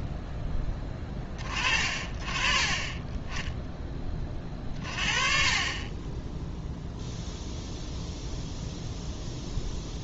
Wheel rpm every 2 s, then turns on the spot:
10, 30, 30, 0, 0.
none